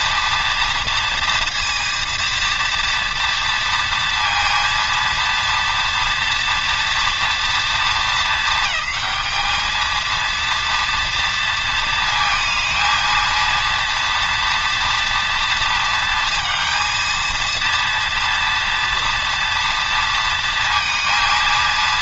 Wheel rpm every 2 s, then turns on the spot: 230, 230, 230, 230, 220, 230, 230, 230, 230, 230, 230.
none